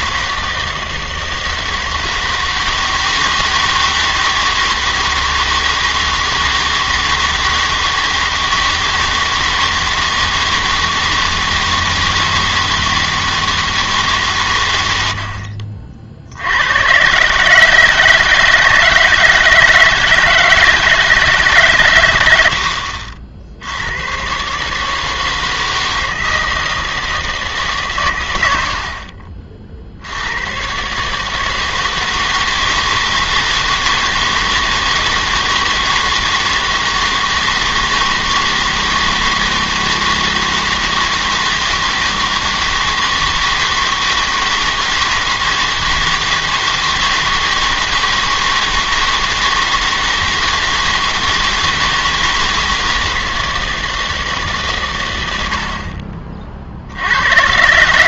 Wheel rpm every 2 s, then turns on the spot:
160, 160, 160, 160, 160, 160, 160, 120, 90, 160, 160, 80, 140, 160, 80, 110, 160, 160, 160, 160, 160, 160, 160, 160, 160, 160, 160, 140, 40.
none